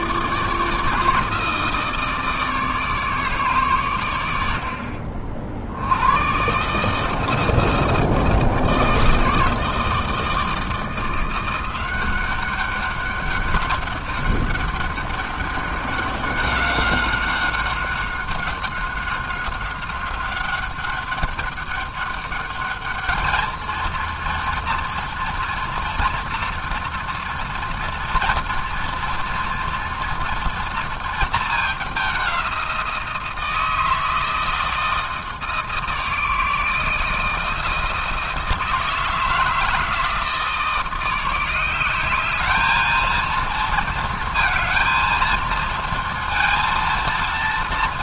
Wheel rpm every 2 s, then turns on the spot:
160, 150, 60, 160, 160, 170, 200, 200, 190, 190, 200, 220, 230, 240, 240, 220, 170, 160, 160, 160, 170, 220, 230, 230.
none